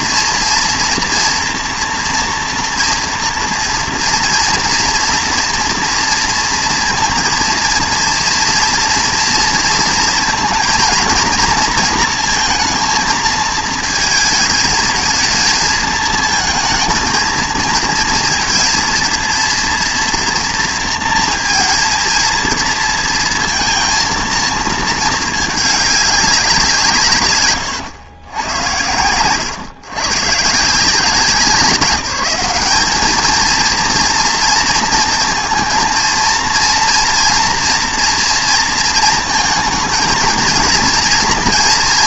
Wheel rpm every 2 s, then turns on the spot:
240, 230, 230, 230, 230, 230, 230, 220, 220, 230, 230, 230, 230, 180, 110, 150, 190, 230, 230, 230, 230.
none